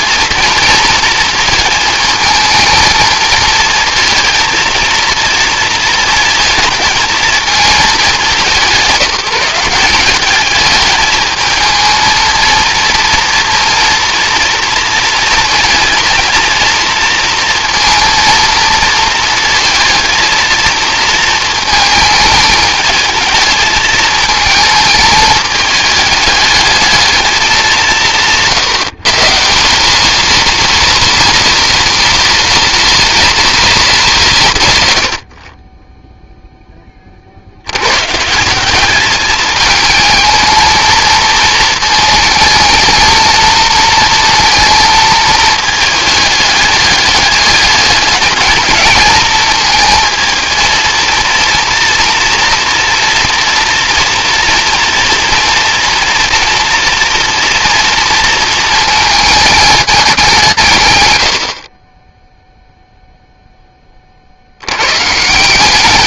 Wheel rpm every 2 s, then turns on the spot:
230, 230, 230, 230, 170, 210, 230, 230, 230, 230, 230, 220, 220, 210, 140, 230, 230, 130, 10, 190, 220, 220, 230, 210, 220, 230, 230, 230, 240, 220, 130, 0, 90.
none